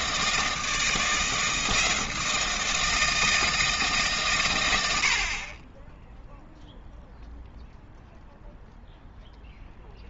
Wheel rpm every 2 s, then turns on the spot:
160, 160, 90, 0, 0.
none